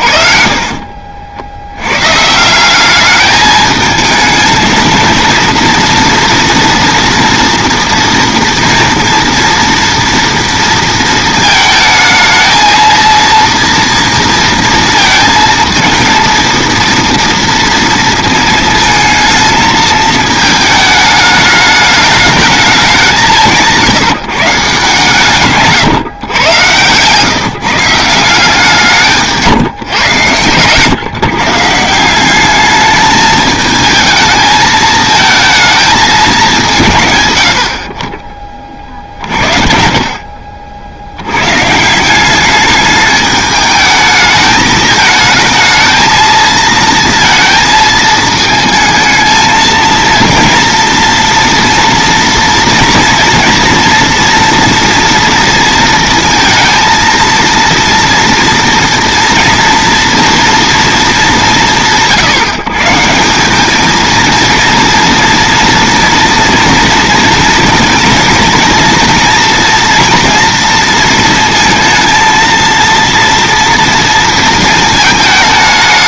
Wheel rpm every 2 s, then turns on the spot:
50, 190, 230, 230, 230, 230, 220, 230, 230, 220, 220, 200, 150, 120, 170, 130, 210, 220, 160, 40, 60, 210, 220, 230, 220, 230, 230, 240, 230, 230, 230, 150, 230, 230, 230, 230, 230, 220.
26-28 38-40